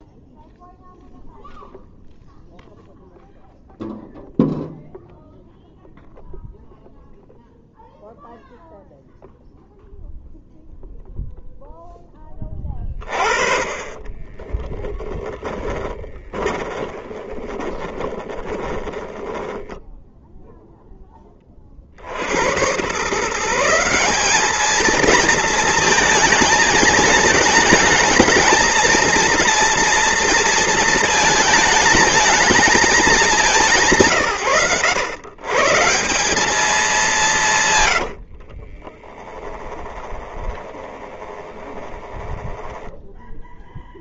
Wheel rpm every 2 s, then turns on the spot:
0, 0, 0, 0, 0, 0, 30, 10, 20, 20, 10, 130, 230, 220, 230, 220, 210, 110, 190, 20, 20, 10.
14-20 38-44